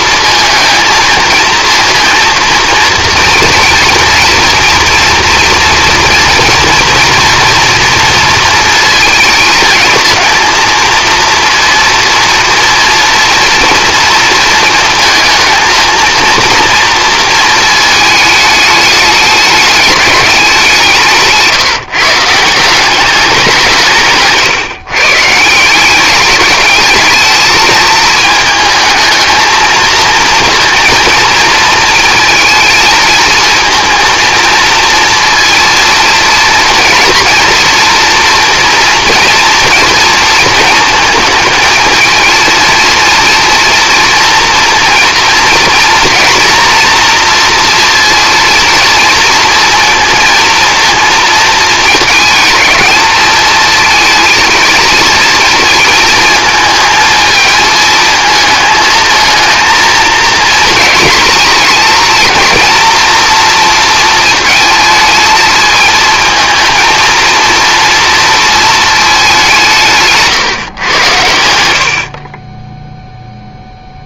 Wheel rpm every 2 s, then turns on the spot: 230, 230, 230, 240, 220, 230, 230, 230, 230, 210, 170, 190, 150, 220, 220, 230, 230, 230, 230, 230, 220, 230, 230, 240, 230, 230, 220, 230, 220, 220, 220, 230, 220, 230, 220, 130, 10.
none